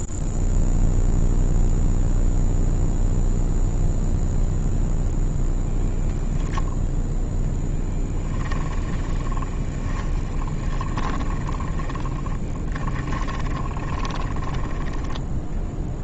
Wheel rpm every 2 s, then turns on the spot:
0, 0, 0, 0, 20, 20, 20, 10.
8-16